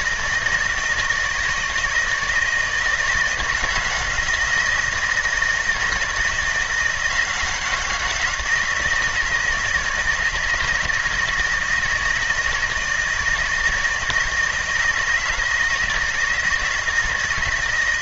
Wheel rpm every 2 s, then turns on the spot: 160, 160, 170, 170, 170, 160, 160, 160, 160.
none